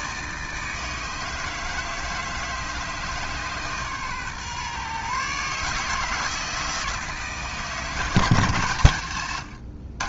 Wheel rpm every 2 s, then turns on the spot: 160, 150, 130, 160, 140.
none